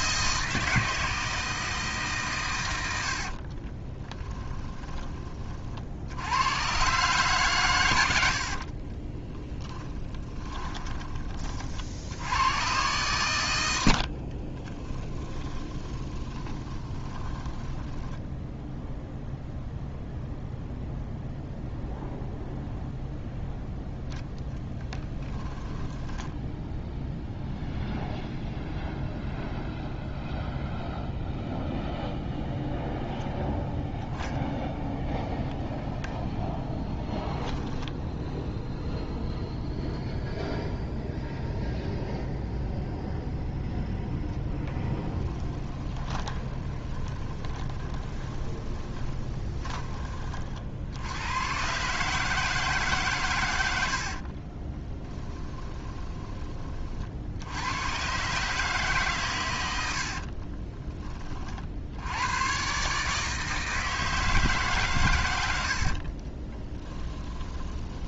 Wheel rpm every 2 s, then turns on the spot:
160, 100, 10, 110, 30, 20, 110, 20, 20, 0, 0, 0, 10, 10, 0, 0, 0, 0, 0, 0, 0, 0, 10, 20, 20, 50, 150, 30, 40, 140, 30, 140, 150, 20.
4-6 8-12 14-18 24-28 44-50 54-56 66-68